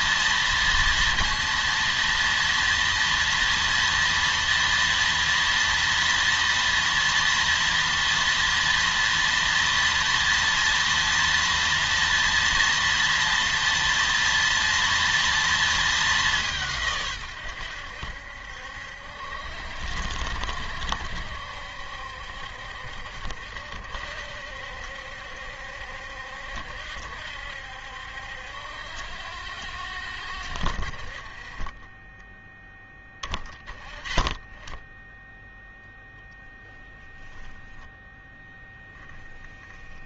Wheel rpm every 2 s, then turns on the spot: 230, 230, 230, 240, 230, 230, 230, 230, 150, 70, 70, 70, 70, 70, 70, 50, 10, 10, 0, 0.
none